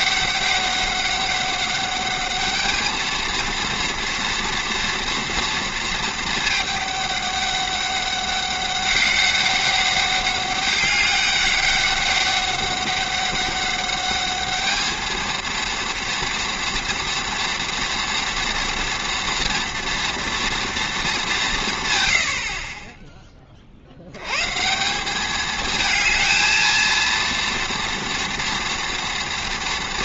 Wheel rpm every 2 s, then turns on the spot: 200, 210, 230, 210, 200, 200, 200, 210, 230, 230, 230, 50, 150, 230, 230.
22-24